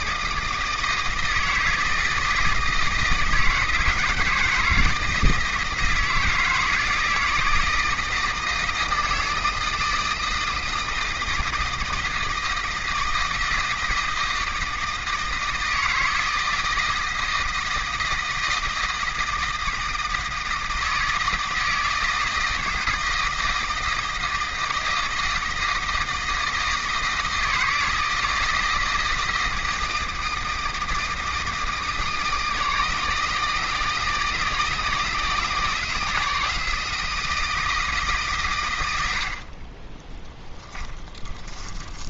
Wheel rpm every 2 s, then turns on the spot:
160, 160, 160, 160, 160, 160, 160, 160, 160, 160, 160, 160, 160, 160, 160, 160, 160, 160, 160, 100, 10.
40-42